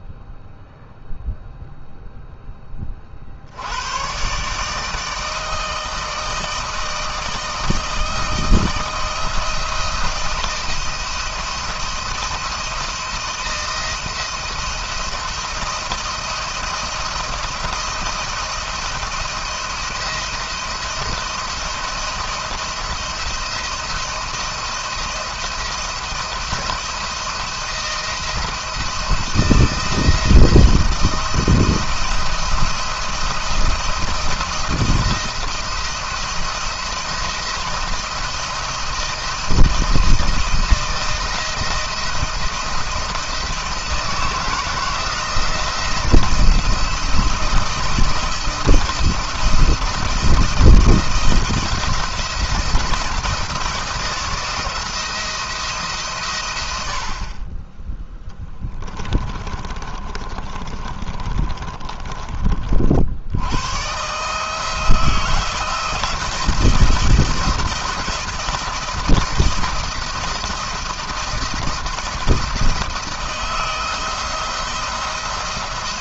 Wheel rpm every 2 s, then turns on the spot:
0, 30, 150, 160, 160, 170, 170, 170, 170, 170, 170, 170, 170, 170, 170, 160, 160, 170, 170, 160, 160, 160, 160, 170, 170, 170, 170, 170, 80, 20, 30, 60, 160, 170, 170, 170, 160, 170.
58-62